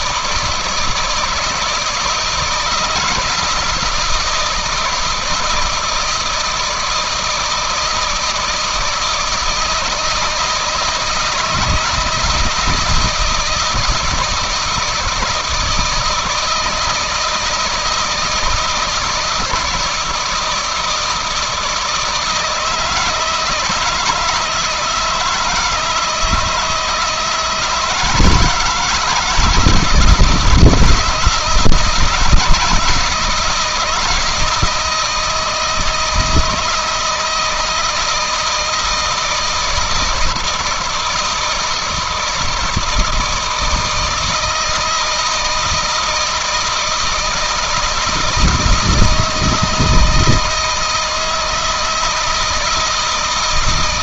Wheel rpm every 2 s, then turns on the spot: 160, 170, 170, 160, 160, 160, 160, 160, 160, 160, 160, 160, 160, 160, 170, 160, 170, 160, 160, 160, 160, 160, 160, 160, 160, 160, 160.
none